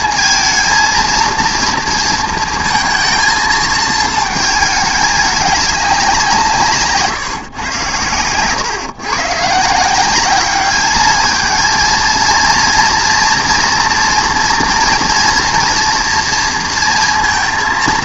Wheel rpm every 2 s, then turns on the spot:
230, 230, 220, 160, 120, 200, 230, 230, 230.
none